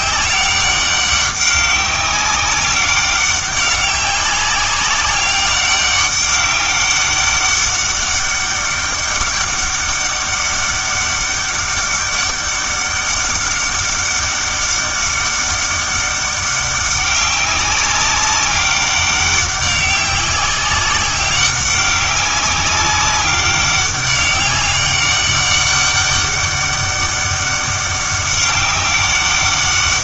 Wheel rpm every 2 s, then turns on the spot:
200, 200, 190, 200, 200, 200, 200, 200, 200, 200, 190, 200, 200, 200, 190.
none